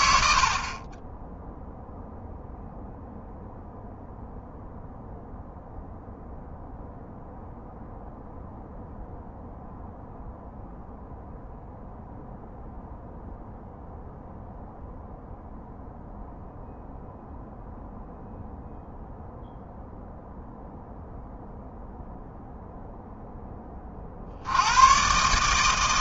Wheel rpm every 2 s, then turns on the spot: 60, 0, 0, 0, 0, 0, 0, 0, 0, 0, 0, 0, 70.
none